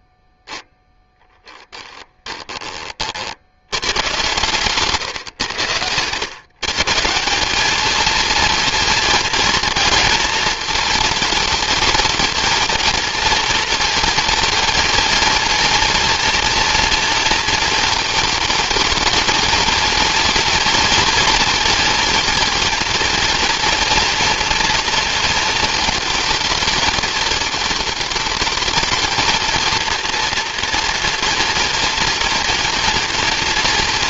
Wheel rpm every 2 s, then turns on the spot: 0, 30, 130, 130, 230, 220, 220, 220, 230, 220, 230, 240, 230, 210, 220, 240, 230.
none